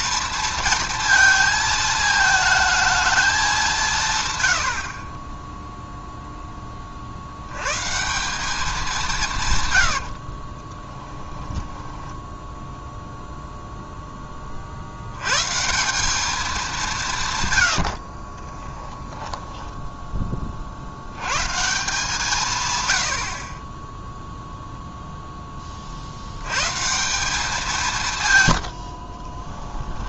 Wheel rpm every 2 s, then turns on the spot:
230, 220, 90, 30, 200, 30, 0, 50, 200, 20, 40, 140, 0, 130, 90.
10-12 18-20 28-30